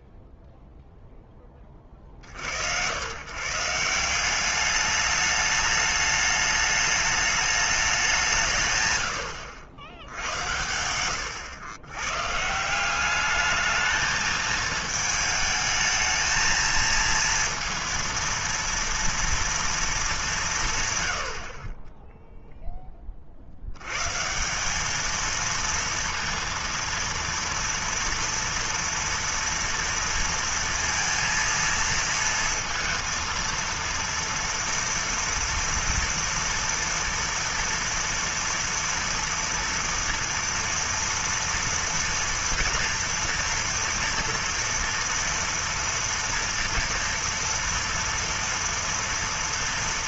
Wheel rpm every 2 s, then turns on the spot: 0, 90, 200, 210, 140, 110, 200, 220, 230, 230, 90, 60, 230, 230, 230, 230, 230, 230, 230, 230, 230, 230, 230, 230, 230.
none